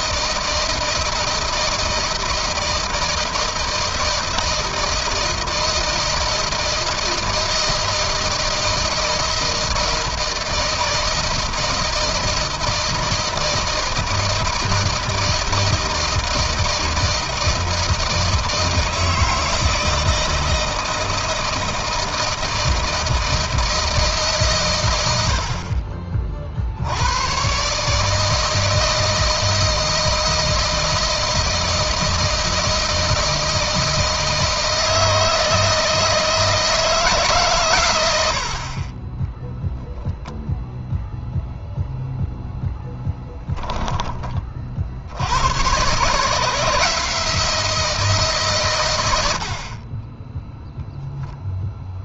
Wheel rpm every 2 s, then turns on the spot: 160, 160, 160, 160, 160, 160, 160, 160, 160, 160, 160, 160, 110, 80, 160, 160, 160, 160, 150, 30, 0, 10, 70, 160, 110, 0.
none